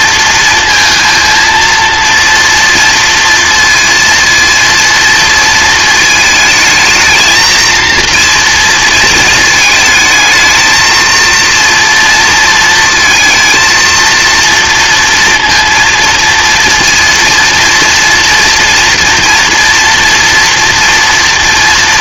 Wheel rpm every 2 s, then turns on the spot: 230, 230, 230, 220, 230, 220, 230, 230, 230, 230, 230.
none